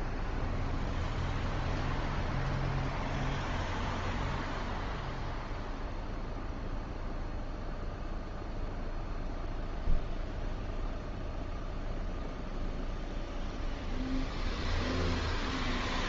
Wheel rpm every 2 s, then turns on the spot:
0, 0, 0, 0, 0, 0, 0, 0.
none